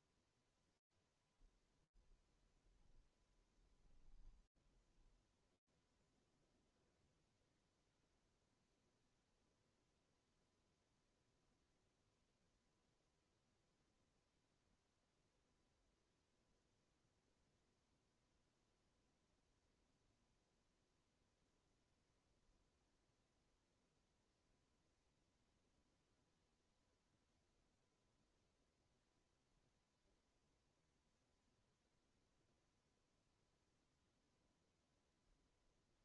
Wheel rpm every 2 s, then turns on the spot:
0, 10, 0, 0, 0, 0, 0, 0, 0, 0, 0, 0, 0, 0, 0, 0, 0, 0.
none